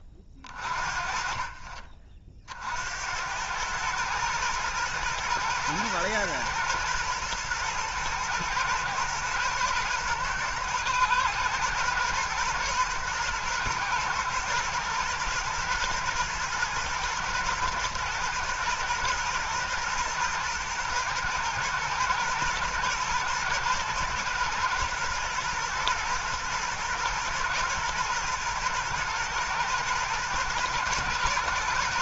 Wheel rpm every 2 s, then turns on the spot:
30, 60, 110, 120, 110, 110, 120, 120, 110, 110, 120, 120, 110, 120, 110, 110.
none